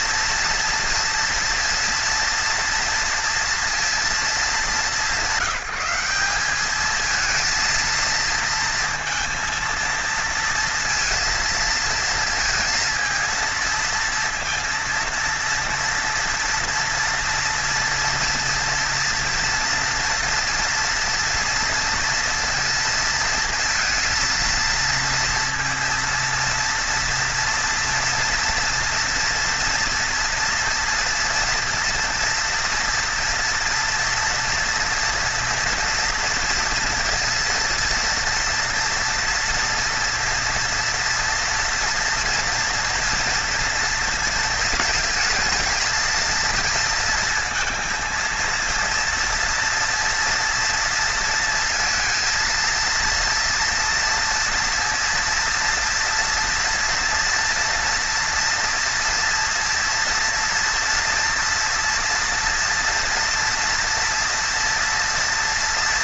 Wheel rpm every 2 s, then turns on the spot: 230, 230, 190, 200, 230, 230, 230, 230, 230, 230, 230, 230, 230, 230, 230, 230, 230, 240, 230, 230, 240, 240, 230, 230, 230, 230, 230, 230, 230, 230, 230, 230, 230.
none